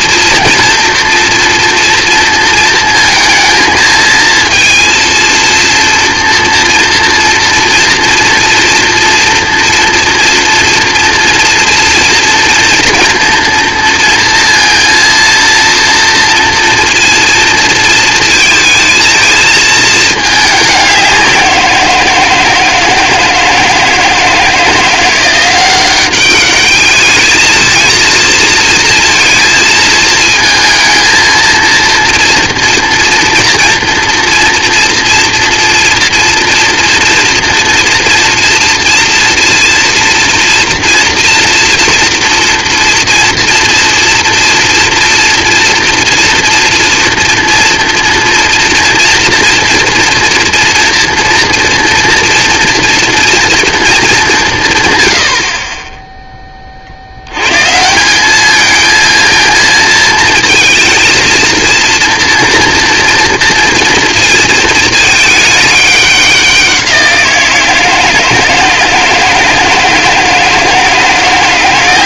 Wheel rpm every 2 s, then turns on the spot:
240, 230, 220, 230, 230, 230, 240, 230, 230, 230, 210, 160, 160, 200, 230, 220, 230, 230, 230, 230, 230, 230, 230, 230, 230, 230, 240, 180, 10, 200, 230, 230, 230, 190, 160, 160.
none